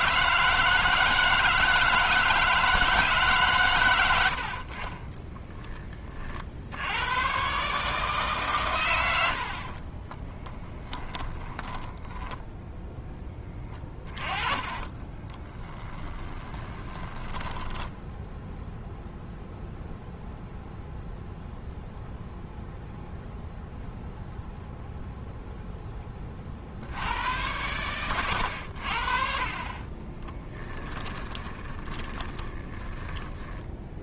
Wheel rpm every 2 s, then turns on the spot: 160, 160, 40, 90, 100, 10, 10, 20, 20, 0, 0, 0, 0, 70, 70, 10, 20.
10-12 14-18 30-34